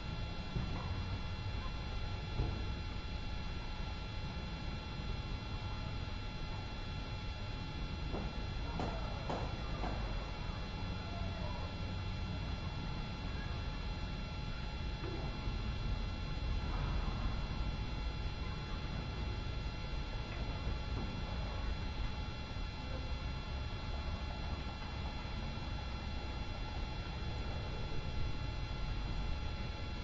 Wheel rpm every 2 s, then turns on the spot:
0, 0, 0, 0, 0, 0, 0, 0, 0, 0, 0, 0, 0, 0, 0.
none